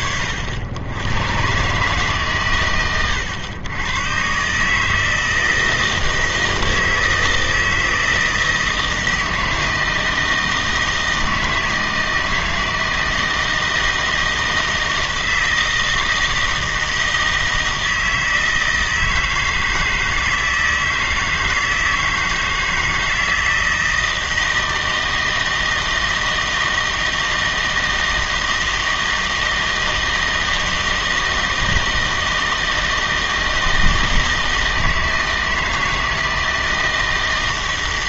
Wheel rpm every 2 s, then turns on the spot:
80, 80, 150, 160, 160, 160, 160, 160, 160, 160, 160, 160, 160, 160, 160, 160, 160, 160, 160.
none